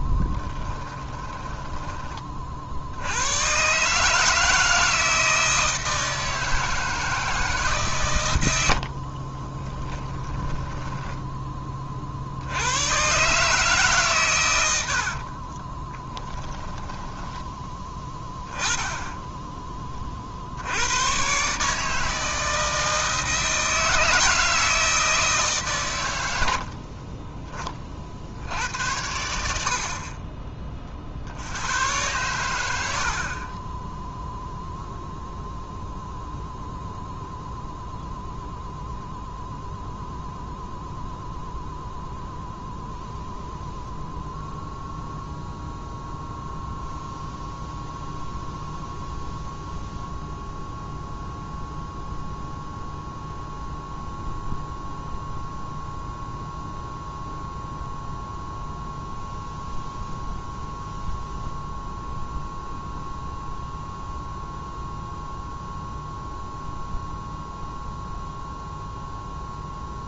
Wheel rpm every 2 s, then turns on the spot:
10, 60, 160, 160, 70, 10, 110, 70, 10, 10, 90, 160, 160, 50, 90, 50, 70, 0, 0, 0, 0, 0, 0, 0, 0, 0, 0, 0, 0, 0, 0, 0, 0, 0, 0.
0-2 8-12 14-18 26-28